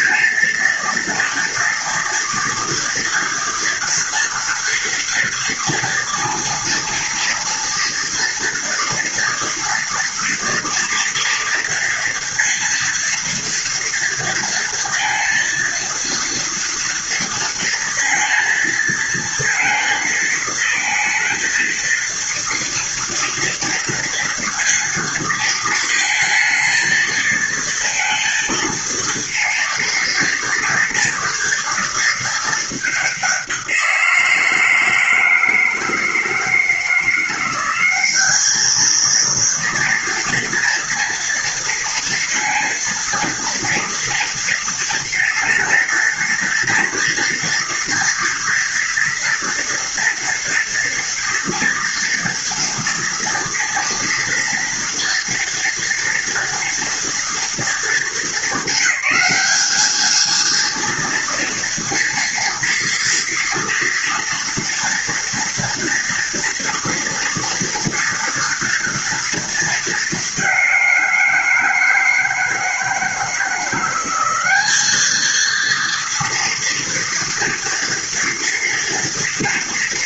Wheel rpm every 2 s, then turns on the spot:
230, 230, 230, 230, 230, 230, 230, 230, 230, 230, 230, 230, 230, 230, 230, 230, 200, 160, 170, 220, 230, 230, 230, 230, 230, 230, 230, 230, 230, 200, 230, 230, 230, 230, 230, 180, 170, 220, 230, 230.
none